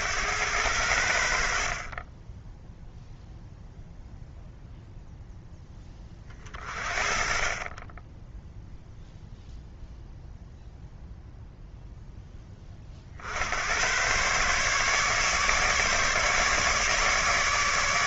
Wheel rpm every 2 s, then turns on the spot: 90, 0, 0, 40, 0, 0, 30, 140, 150.
none